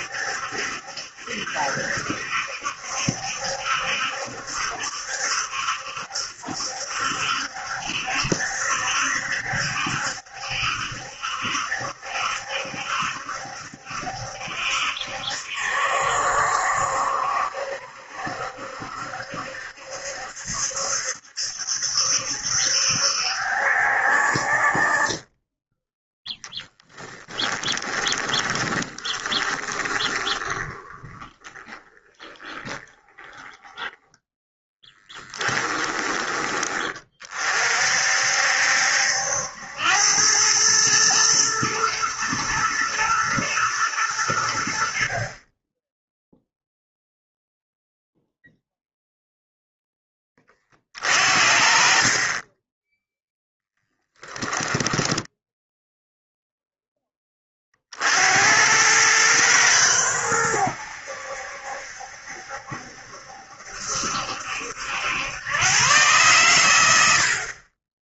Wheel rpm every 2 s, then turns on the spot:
70, 70, 70, 70, 70, 70, 70, 70, 70, 70, 70, 70, 40, 10, 20, 10, 20, 10, 30, 70, 110, 110, 70, 0, 0, 30, 10, 10, 0, 100, 90, 70, 80, 100.
28-36 54-56